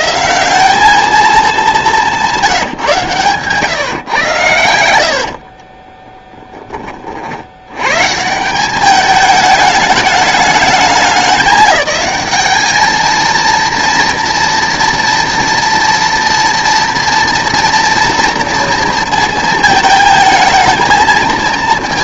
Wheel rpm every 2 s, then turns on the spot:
190, 170, 90, 30, 190, 210, 210, 240, 230, 230, 230.
2-6